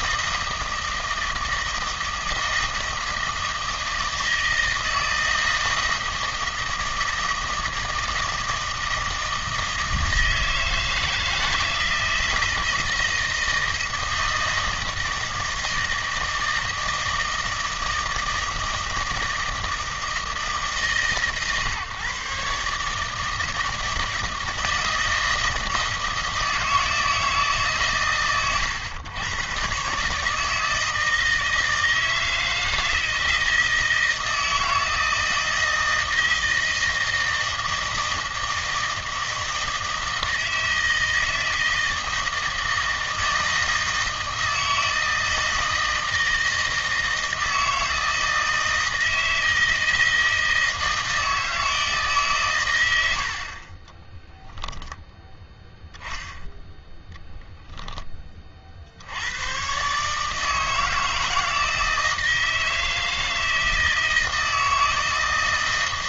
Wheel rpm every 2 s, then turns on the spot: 160, 160, 160, 160, 160, 160, 160, 160, 160, 160, 150, 140, 160, 160, 120, 160, 160, 160, 160, 160, 160, 160, 160, 160, 160, 160, 120, 10, 0, 50, 160, 160, 160.
none